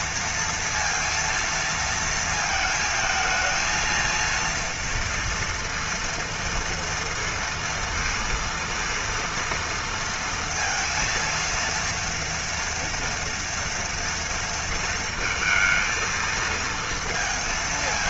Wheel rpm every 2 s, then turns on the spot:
230, 220, 230, 230, 230, 230, 230, 220, 230.
none